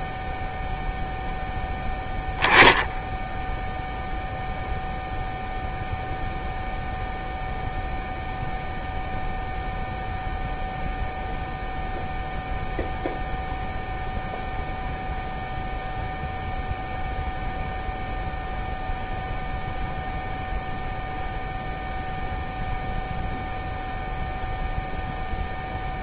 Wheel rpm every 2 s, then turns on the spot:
0, 0, 0, 0, 0, 0, 0, 0, 0, 0, 0, 0, 0.
none